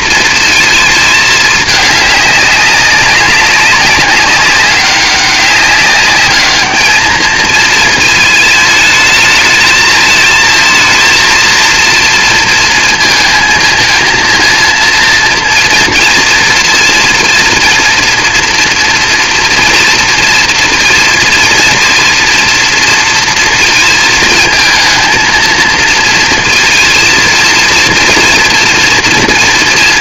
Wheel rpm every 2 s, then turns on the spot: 230, 200, 200, 210, 220, 220, 230, 230, 230, 230, 230, 230, 220, 230, 240.
none